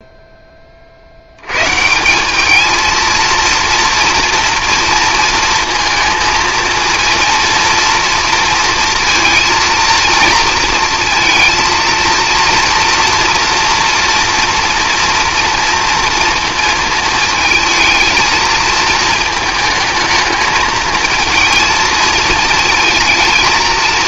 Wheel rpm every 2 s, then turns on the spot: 40, 220, 230, 230, 230, 230, 230, 230, 230, 220, 220, 230.
none